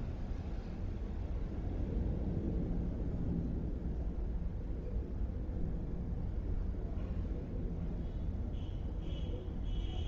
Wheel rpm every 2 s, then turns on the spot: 0, 0, 0, 0, 0.
none